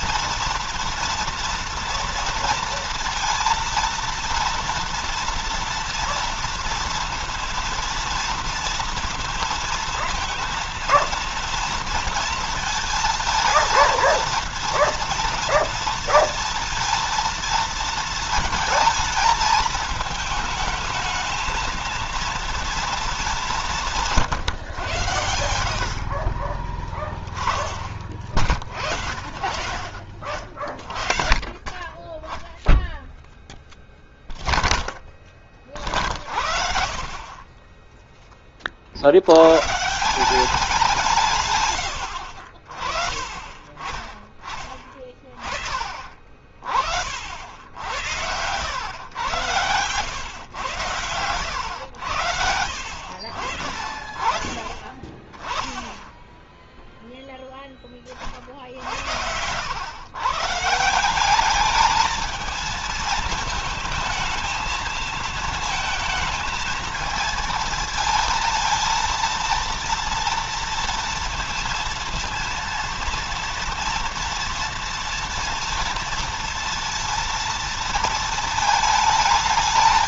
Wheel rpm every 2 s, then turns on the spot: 230, 230, 230, 230, 230, 230, 230, 230, 230, 220, 220, 220, 110, 20, 50, 40, 0, 0, 50, 50, 180, 50, 30, 60, 120, 110, 80, 20, 0, 60, 160, 220, 220, 220, 230, 230, 230, 230, 230, 220.
none